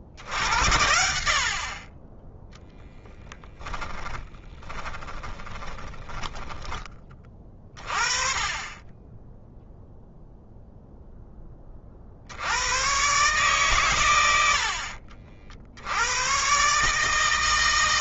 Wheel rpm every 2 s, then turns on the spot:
80, 10, 20, 20, 20, 0, 110, 70, 140.
4-6 14-16